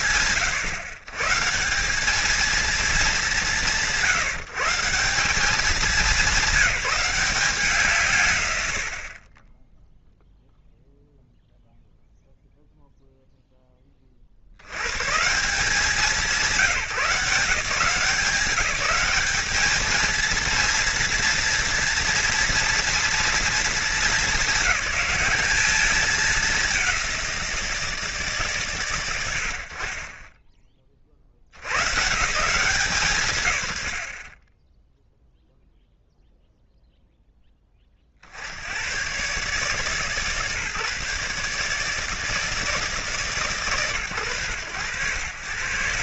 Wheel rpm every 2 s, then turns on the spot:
130, 210, 190, 180, 40, 0, 0, 120, 190, 200, 230, 230, 210, 200, 110, 20, 160, 10, 0, 80, 150, 160, 100.
none